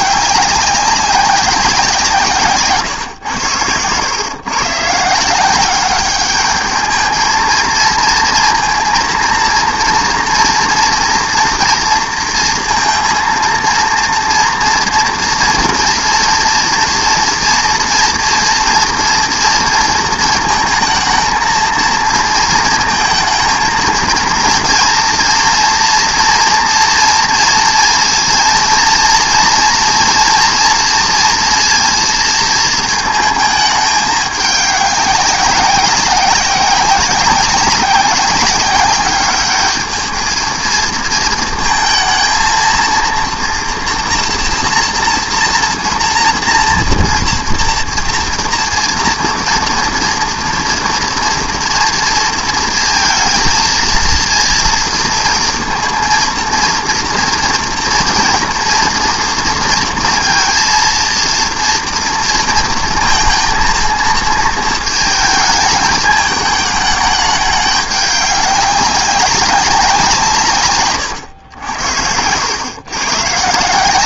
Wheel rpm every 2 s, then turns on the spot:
190, 150, 130, 210, 230, 240, 230, 230, 230, 230, 230, 230, 240, 230, 230, 230, 230, 200, 190, 200, 220, 230, 240, 230, 230, 230, 230, 230, 230, 230, 230, 230, 220, 210, 200, 140, 100.
none